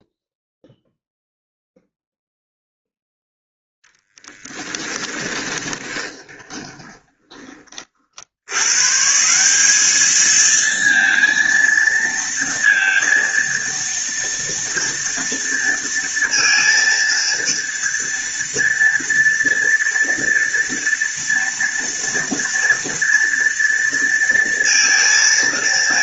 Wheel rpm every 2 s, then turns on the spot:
0, 0, 10, 20, 110, 220, 230, 230, 230, 230, 230, 230, 230.
4-8